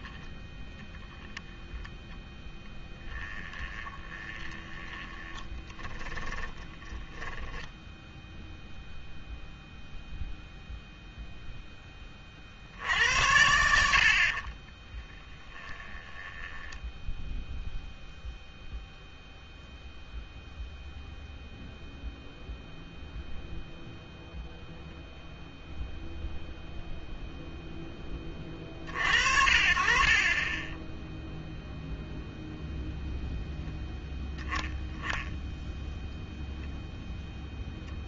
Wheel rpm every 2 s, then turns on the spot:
10, 10, 20, 20, 0, 0, 70, 30, 10, 0, 0, 0, 0, 0, 40, 20, 0, 10, 0.
2-8 14-18 30-32